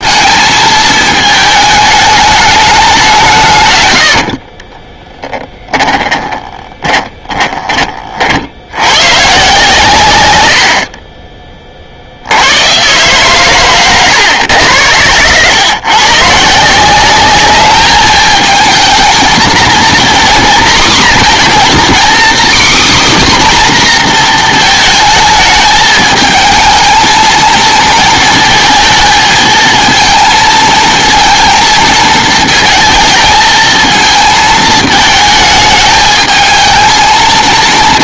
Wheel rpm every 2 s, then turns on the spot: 220, 190, 30, 20, 100, 50, 110, 100, 180, 220, 250, 270, 220, 220, 220, 230, 220, 220, 220.
4-8